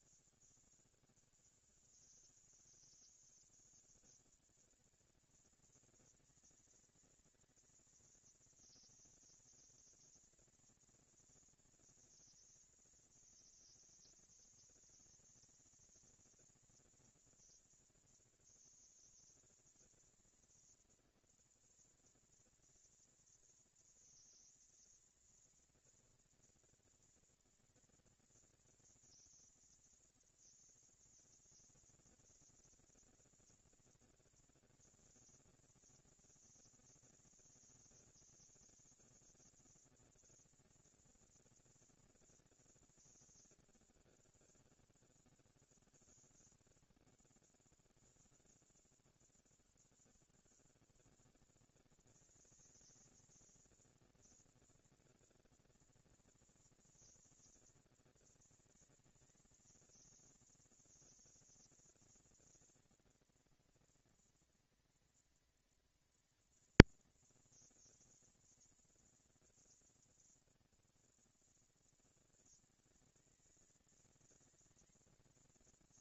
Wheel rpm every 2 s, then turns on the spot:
160, 170, 210, 230, 230, 230, 230, 230, 230, 230, 230, 230, 230, 230, 240, 230, 230, 230, 230, 230, 220, 230, 190, 130, 80, 160, 210, 230, 230, 230, 230, 230, 230, 230, 230, 230, 220, 220.
none